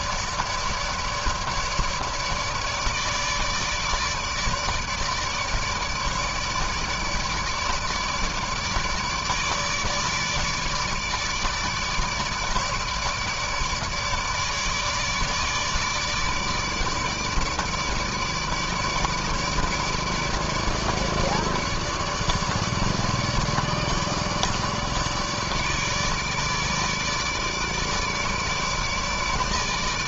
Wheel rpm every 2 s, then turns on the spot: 150, 150, 150, 150, 150, 150, 150, 150, 150, 150, 150, 150, 150, 150, 150.
none